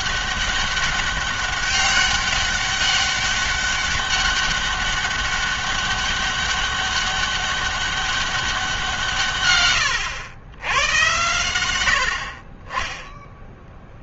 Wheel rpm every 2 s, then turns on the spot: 200, 200, 200, 200, 180, 100, 40.
none